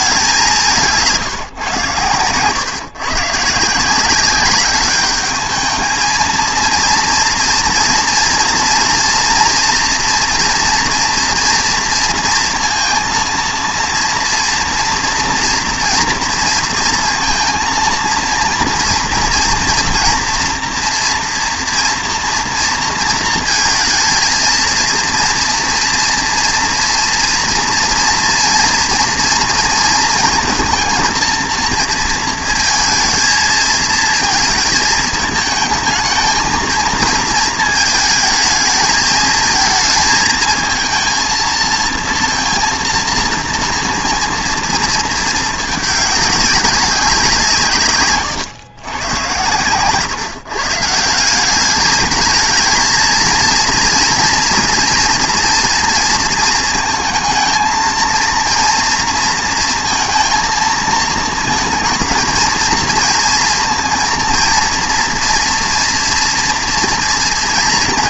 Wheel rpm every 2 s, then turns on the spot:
180, 140, 200, 230, 230, 230, 230, 230, 220, 230, 240, 230, 230, 230, 230, 230, 220, 220, 220, 220, 230, 230, 230, 190, 110, 160, 220, 230, 230, 230, 230, 230, 240, 230.
none